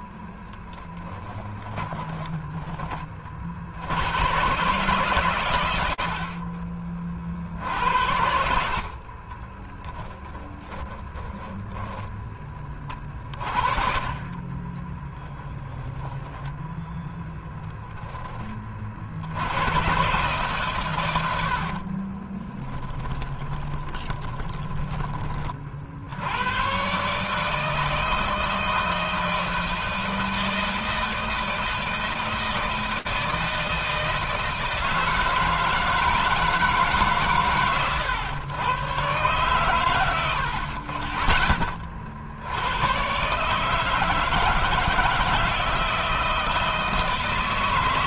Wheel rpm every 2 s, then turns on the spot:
10, 30, 120, 40, 50, 20, 30, 20, 0, 40, 140, 30, 20, 130, 160, 160, 160, 160, 150, 120, 50, 110, 160, 160.
0-2 10-12 14-16 22-24